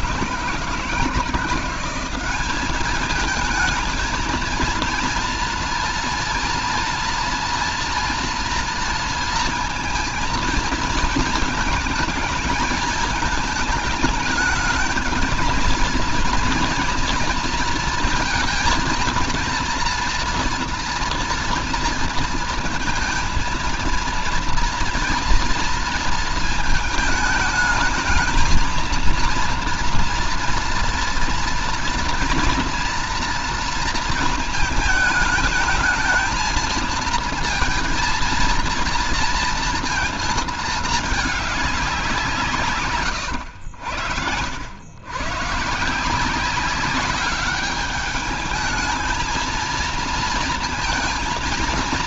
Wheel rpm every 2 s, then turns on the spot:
160, 200, 230, 230, 230, 220, 220, 210, 230, 230, 230, 230, 230, 220, 220, 230, 230, 220, 230, 230, 220, 160, 80, 190, 220, 230.
none